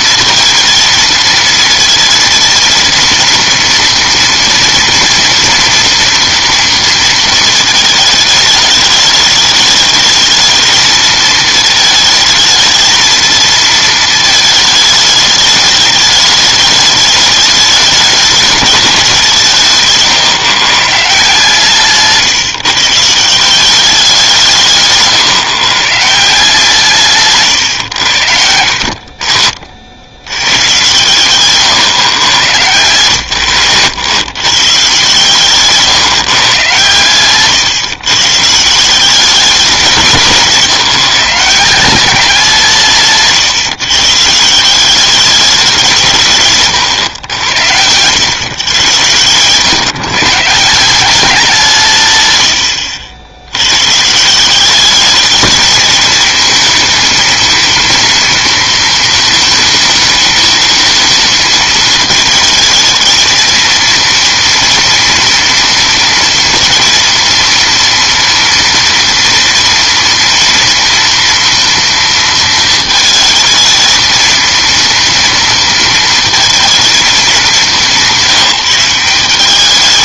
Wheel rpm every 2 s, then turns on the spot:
230, 230, 230, 230, 210, 220, 220, 210, 210, 210, 140, 160, 150, 130, 50, 110, 110, 140, 120, 150, 160, 160, 170, 130, 120, 170, 90, 190, 230, 230, 220, 220, 240, 230, 230, 230, 230, 230, 230, 180.
none